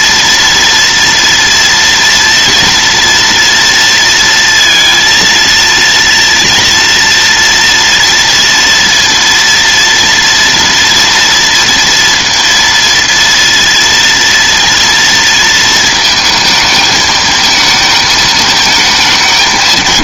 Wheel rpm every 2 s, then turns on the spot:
230, 230, 230, 230, 230, 230, 230, 230, 220, 190.
none